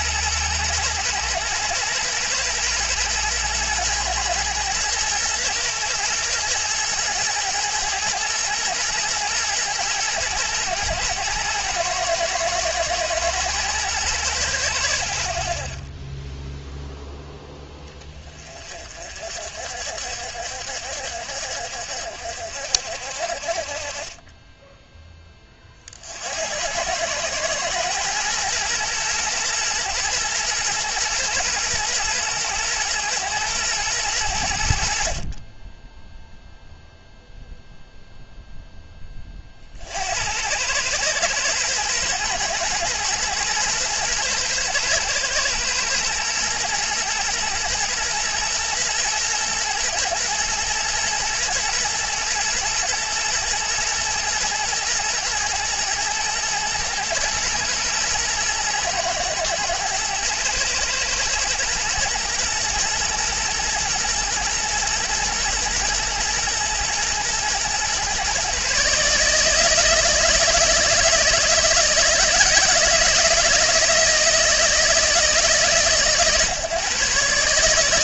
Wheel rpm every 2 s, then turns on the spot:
120, 120, 120, 120, 110, 110, 110, 80, 0, 40, 70, 60, 10, 90, 120, 110, 110, 60, 0, 0, 100, 120, 110, 120, 120, 120, 120, 110, 120, 120, 110, 120, 120, 120, 140, 160, 160, 160, 130.
none